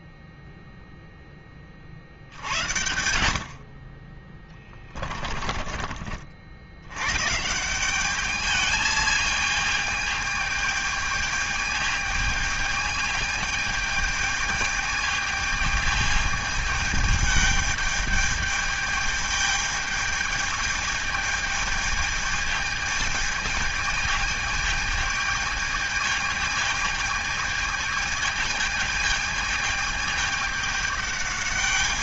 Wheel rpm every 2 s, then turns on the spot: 0, 80, 30, 70, 210, 220, 220, 210, 210, 210, 210, 220, 210, 220, 220, 210.
4-6